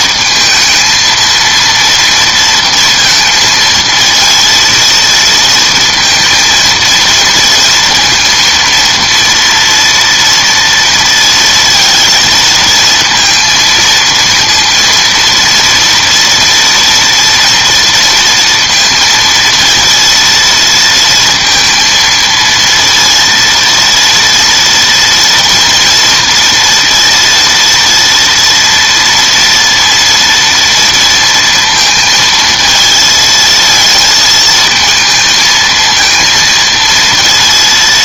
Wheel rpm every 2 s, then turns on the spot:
220, 230, 230, 230, 230, 230, 230, 230, 230, 230, 230, 230, 230, 230, 230, 230, 220, 220, 230.
none